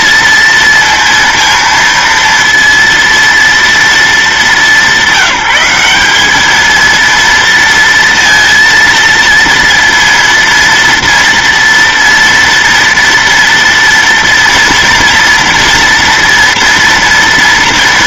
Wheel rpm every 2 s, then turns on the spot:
230, 230, 180, 220, 230, 230, 230, 230, 240.
none